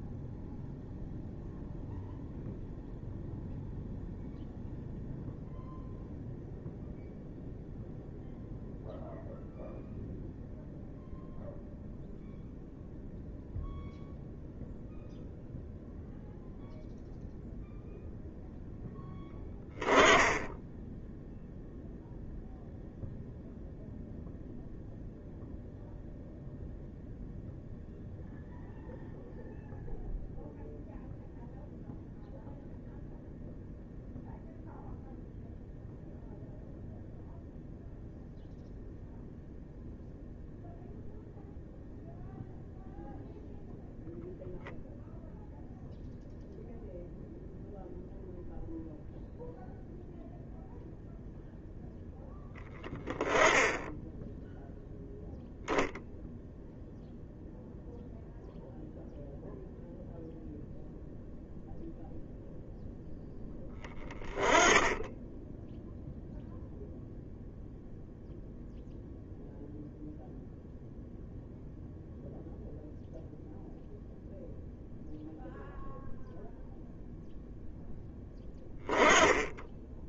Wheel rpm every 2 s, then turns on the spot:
0, 0, 0, 0, 0, 0, 0, 0, 0, 10, 10, 0, 0, 0, 0, 0, 0, 0, 0, 0, 0, 0, 0, 0, 0, 0, 10, 0, 0, 0, 0, 0, 10, 0, 0, 0, 0, 0, 0, 10.
none